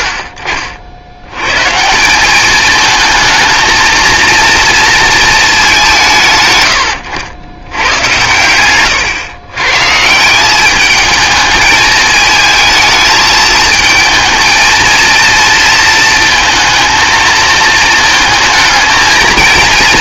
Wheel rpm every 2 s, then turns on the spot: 80, 220, 230, 110, 110, 200, 220, 220, 230, 220.
8-10